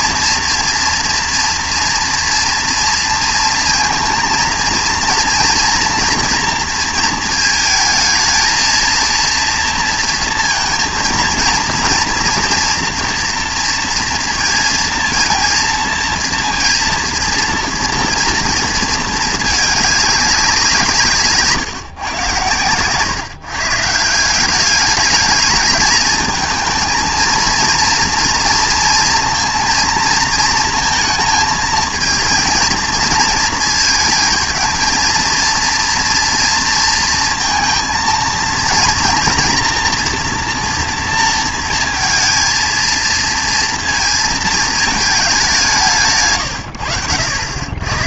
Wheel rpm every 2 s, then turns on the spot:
240, 230, 230, 230, 220, 230, 240, 230, 230, 230, 160, 120, 210, 230, 230, 230, 230, 230, 230, 230, 230, 230, 220, 110.
none